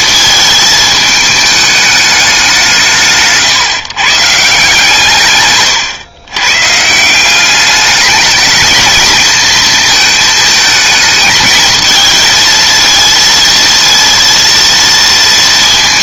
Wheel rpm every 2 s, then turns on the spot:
220, 170, 160, 150, 210, 220, 230, 230.
none